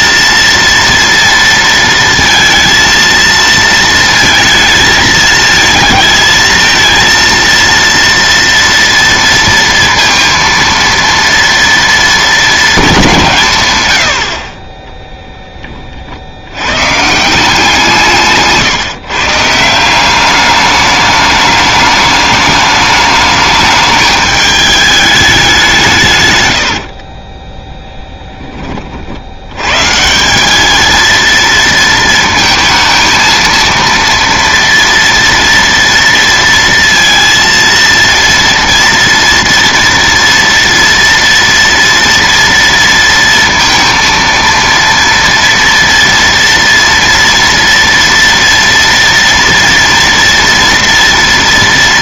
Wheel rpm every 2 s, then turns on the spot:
230, 230, 220, 220, 230, 230, 210, 30, 110, 150, 200, 210, 210, 90, 30, 210, 230, 230, 230, 230, 230, 230, 230, 230, 230, 230.
14-16 26-28